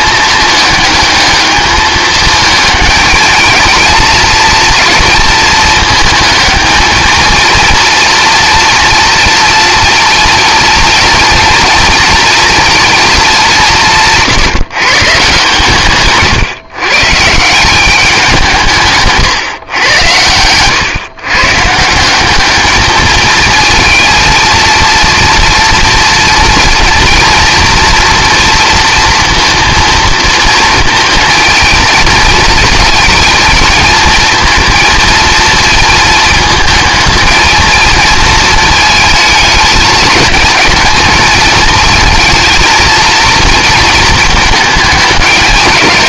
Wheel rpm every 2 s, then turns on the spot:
210, 220, 230, 220, 240, 230, 230, 150, 140, 170, 120, 220, 230, 230, 230, 230, 220, 230, 220, 220, 220, 230, 220.
none